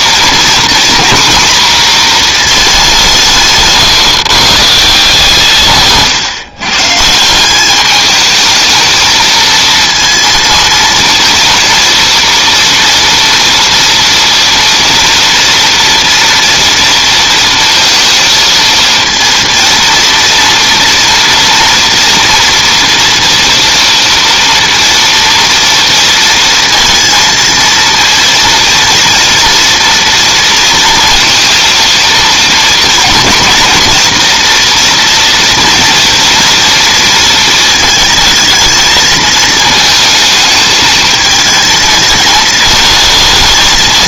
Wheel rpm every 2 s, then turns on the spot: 240, 200, 150, 140, 220, 230, 230, 230, 240, 230, 230, 230, 230, 230, 230, 230, 220, 230, 230, 220, 220, 220.
none